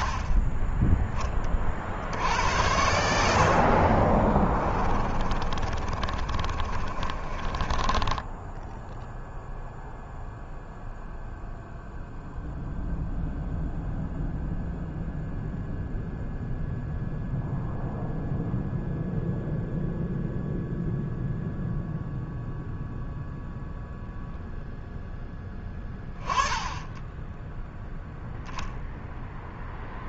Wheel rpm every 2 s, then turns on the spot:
10, 70, 30, 30, 0, 0, 0, 0, 0, 0, 0, 0, 10, 10, 0.
4-8